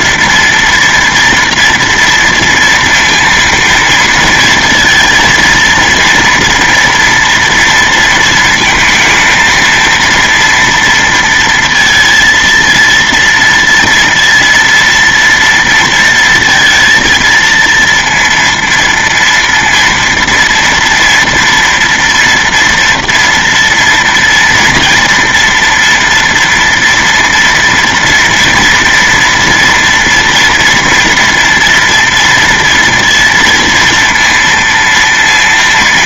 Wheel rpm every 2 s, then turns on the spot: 230, 230, 230, 240, 230, 230, 230, 230, 230, 230, 230, 230, 230, 230, 230, 230, 230, 230.
none